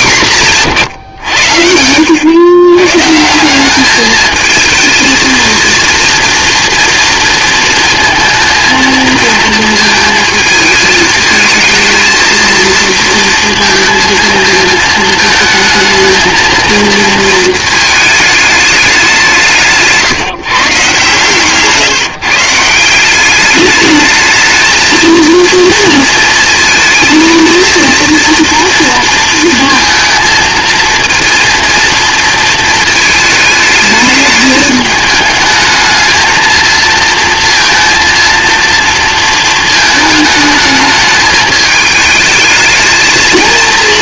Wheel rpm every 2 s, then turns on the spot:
130, 140, 230, 230, 230, 220, 230, 220, 230, 190, 140, 180, 230, 220, 230, 230, 220, 220, 230, 230, 210, 220.
none